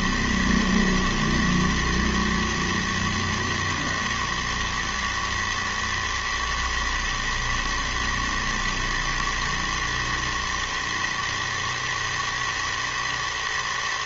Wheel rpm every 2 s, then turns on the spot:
120, 110, 110, 110, 120, 110, 110.
none